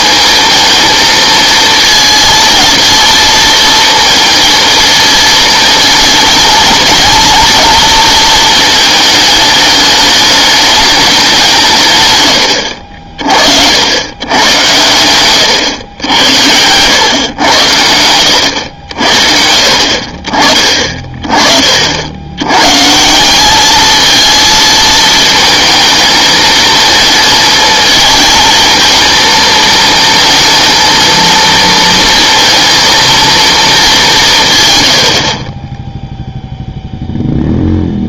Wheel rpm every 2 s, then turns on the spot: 220, 230, 230, 230, 220, 210, 80, 110, 100, 80, 40, 130, 230, 220, 230, 230, 230, 120, 0.
none